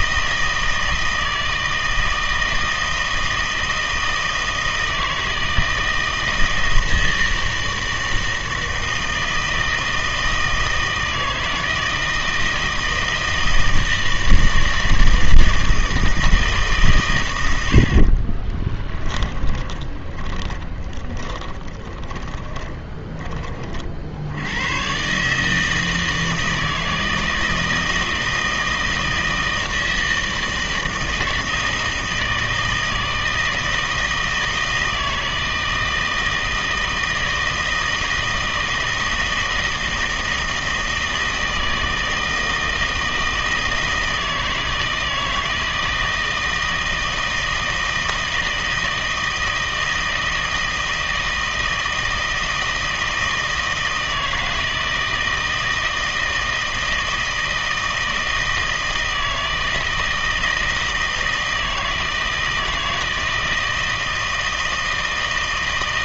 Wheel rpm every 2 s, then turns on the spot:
160, 160, 160, 160, 160, 160, 160, 160, 150, 20, 10, 20, 100, 160, 160, 160, 160, 160, 160, 160, 160, 160, 160, 160, 160, 160, 160, 160, 160, 160, 160, 160, 160.
18-24